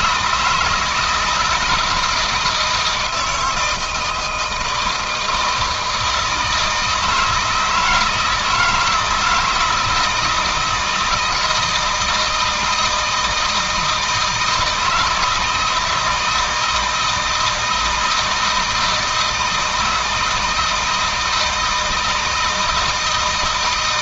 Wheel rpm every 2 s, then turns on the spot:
170, 160, 160, 160, 160, 160, 160, 160, 160, 160, 160, 160.
none